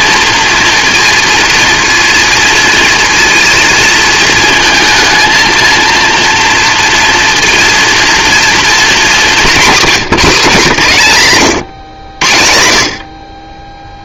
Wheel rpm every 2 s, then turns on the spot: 230, 230, 230, 230, 230, 190, 80.
none